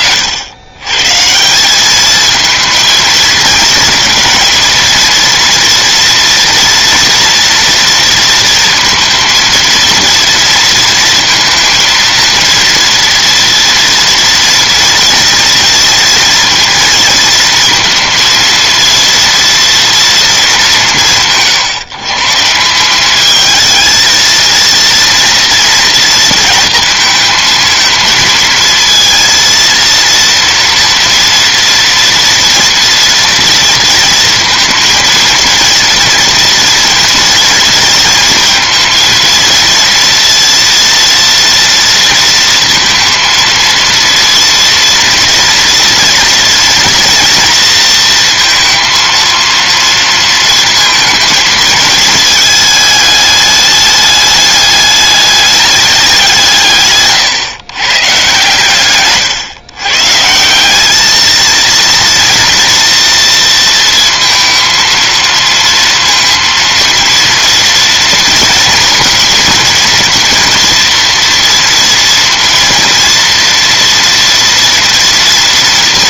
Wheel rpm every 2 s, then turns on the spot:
110, 220, 230, 230, 230, 230, 230, 230, 230, 230, 190, 180, 230, 230, 230, 230, 230, 230, 230, 230, 230, 230, 230, 230, 230, 230, 210, 210, 150, 130, 190, 230, 230, 230, 230, 230, 230, 240.
58-60